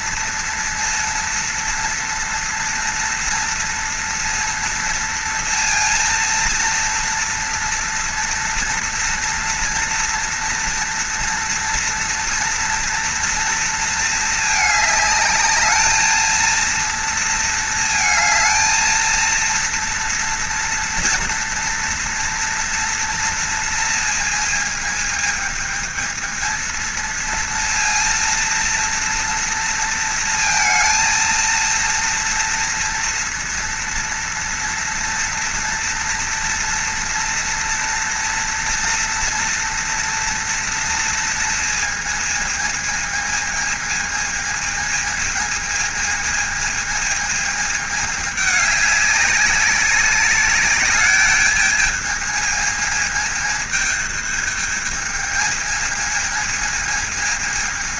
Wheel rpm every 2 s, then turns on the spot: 230, 230, 230, 230, 230, 240, 230, 220, 230, 230, 230, 230, 220, 220, 230, 230, 230, 230, 230, 230, 230, 220, 220, 220, 200, 200, 220, 220, 220.
none